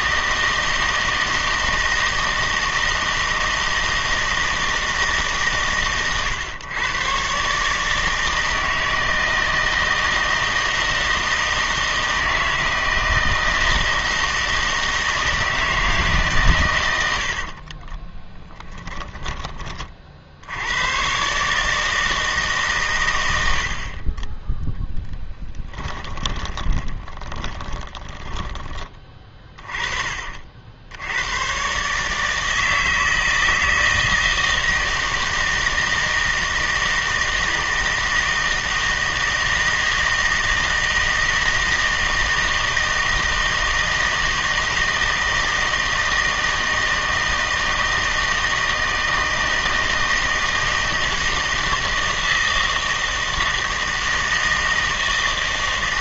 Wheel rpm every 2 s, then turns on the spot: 160, 160, 160, 120, 160, 160, 160, 160, 110, 10, 90, 140, 10, 20, 20, 60, 160, 160, 160, 160, 160, 160, 160, 160, 160, 160, 160, 160.
18-20 26-30